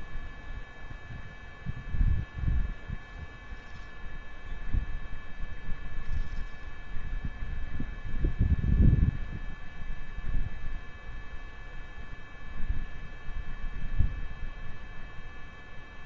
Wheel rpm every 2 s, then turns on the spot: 0, 0, 0, 0, 0, 0, 0, 0.
none